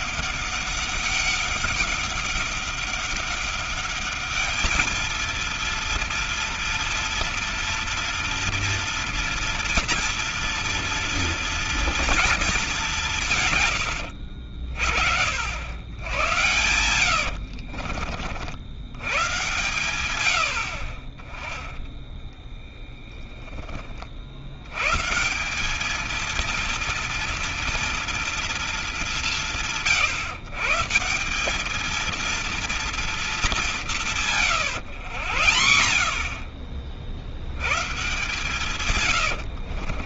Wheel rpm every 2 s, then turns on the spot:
200, 200, 220, 230, 230, 230, 210, 70, 100, 80, 70, 10, 110, 230, 220, 160, 230, 130, 50, 130.
16-18 20-24 38-40